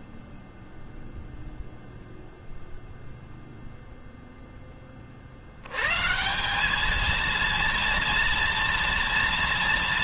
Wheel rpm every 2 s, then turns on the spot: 0, 0, 30, 210, 230.
none